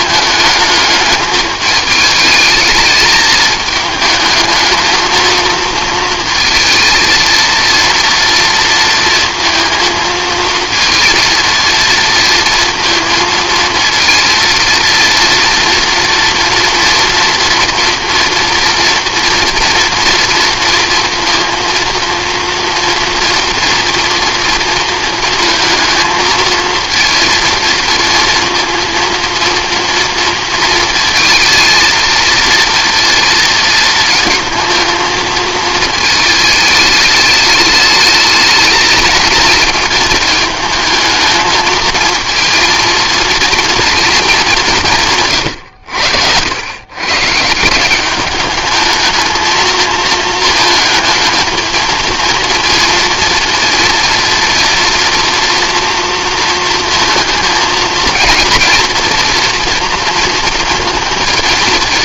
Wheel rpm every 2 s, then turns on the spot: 220, 220, 220, 230, 230, 230, 230, 230, 230, 230, 230, 230, 230, 230, 230, 230, 230, 220, 220, 210, 220, 230, 190, 110, 210, 220, 230, 230, 230, 230, 230.
none